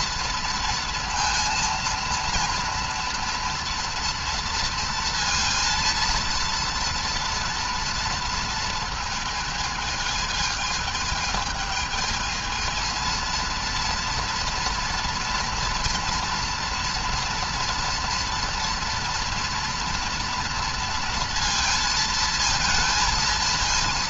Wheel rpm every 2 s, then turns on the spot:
230, 230, 230, 230, 230, 220, 220, 230, 240, 230, 230, 220.
none